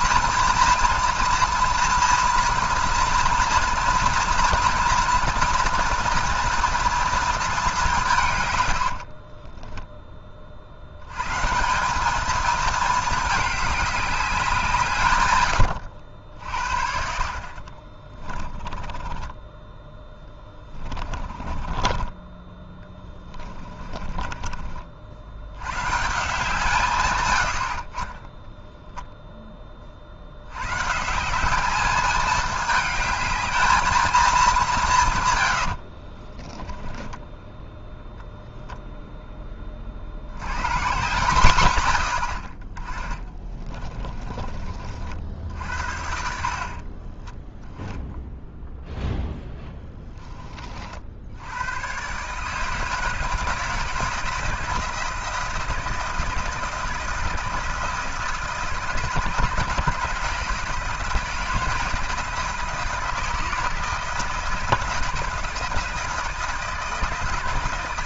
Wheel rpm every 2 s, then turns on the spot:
230, 230, 240, 230, 110, 60, 220, 180, 70, 20, 20, 20, 30, 160, 10, 120, 210, 180, 10, 0, 120, 30, 30, 50, 0, 40, 150, 160, 160, 160, 170, 160, 160, 160.
8-10 18-22 36-38